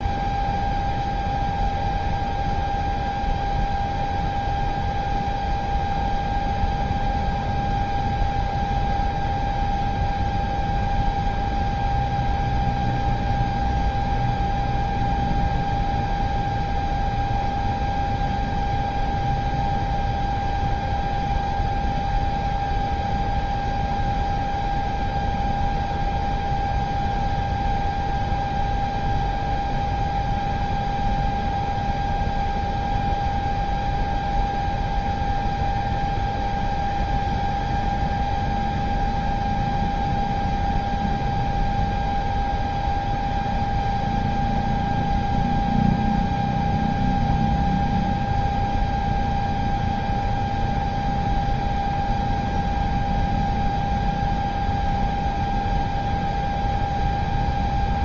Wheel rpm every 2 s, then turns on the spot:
0, 0, 0, 0, 0, 0, 0, 0, 0, 0, 0, 0, 0, 0, 0, 0, 0, 0, 0, 0, 0, 0, 0, 0, 0, 0, 0, 0, 0.
none